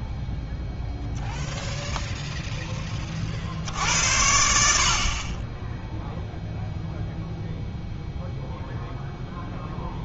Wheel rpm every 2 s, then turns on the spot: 0, 20, 70, 0, 0.
none